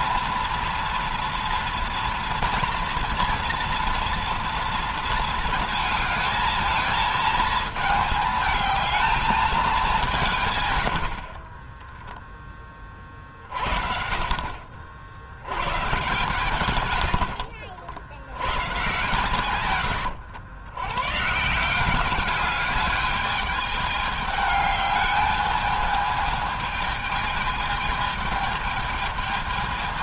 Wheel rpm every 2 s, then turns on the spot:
230, 230, 230, 220, 220, 150, 20, 50, 120, 110, 100, 200, 210, 220, 220.
none